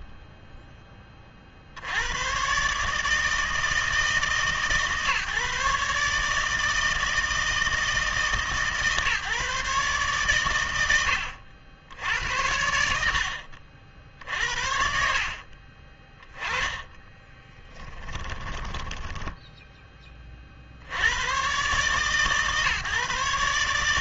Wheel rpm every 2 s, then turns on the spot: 20, 140, 140, 160, 150, 100, 80, 80, 20, 10, 60, 140.
0-2 16-20